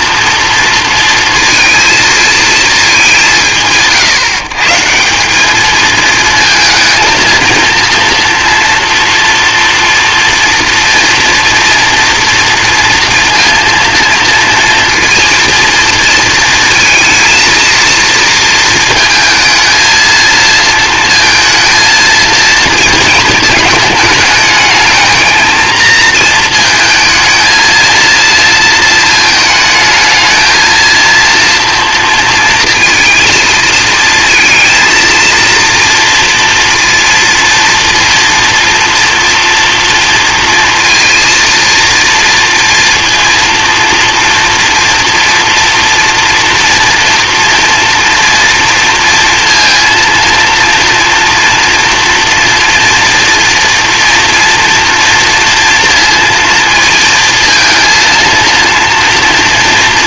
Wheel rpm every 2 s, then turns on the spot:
230, 220, 150, 230, 230, 240, 240, 230, 230, 220, 230, 230, 220, 220, 230, 230, 230, 220, 230, 230, 230, 230, 230, 240, 230, 230, 230, 230, 230, 230.
none